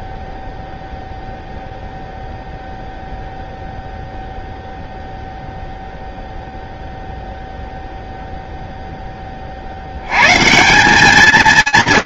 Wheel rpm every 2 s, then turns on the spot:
0, 0, 0, 0, 0, 150.
none